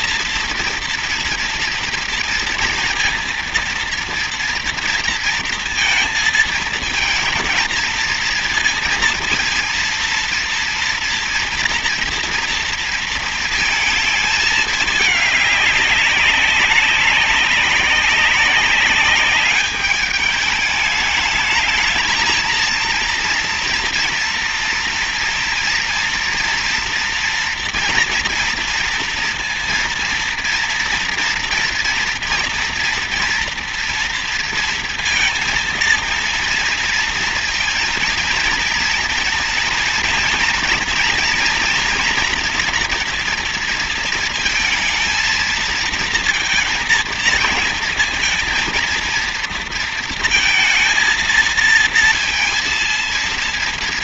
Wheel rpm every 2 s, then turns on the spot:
240, 230, 230, 220, 230, 230, 230, 210, 190, 200, 210, 230, 230, 230, 230, 230, 230, 230, 230, 230, 230, 230, 230, 230, 230, 230, 230.
none